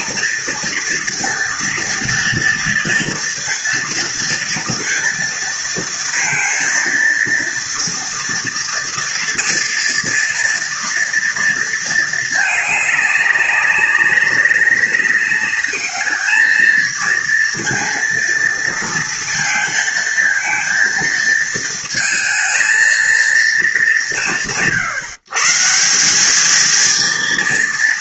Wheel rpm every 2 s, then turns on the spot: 230, 240, 230, 230, 230, 230, 200, 200, 230, 230, 230, 230, 140, 230.
none